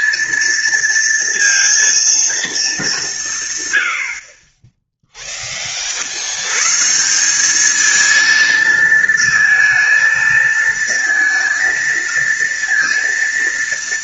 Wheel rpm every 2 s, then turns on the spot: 230, 200, 10, 140, 220, 230, 230.
none